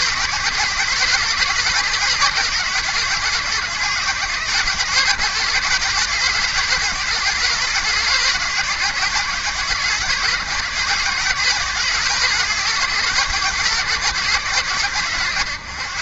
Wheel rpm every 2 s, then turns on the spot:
140, 140, 140, 140, 130, 130, 140, 120.
none